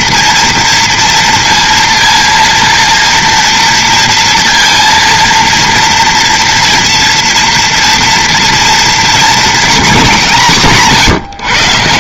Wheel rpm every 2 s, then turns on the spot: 230, 230, 230, 230, 230, 180.
none